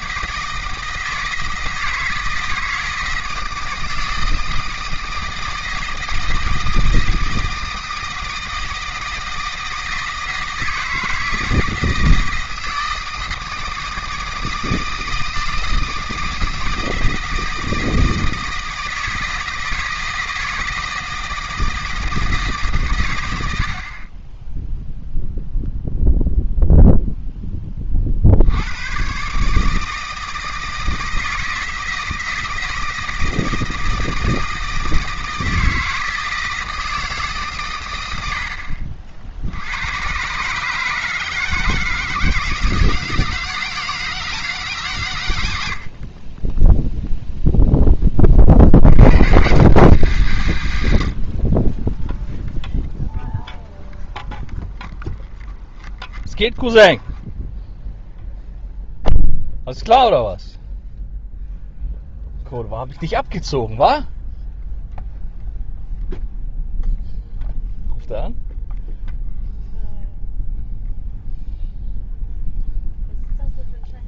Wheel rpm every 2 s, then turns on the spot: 160, 160, 160, 160, 160, 160, 160, 160, 160, 160, 160, 140, 0, 0, 100, 160, 160, 160, 160, 50, 150, 160, 140, 10, 70, 130, 0, 0, 0, 0, 0, 0, 0, 0, 0, 0, 0.
none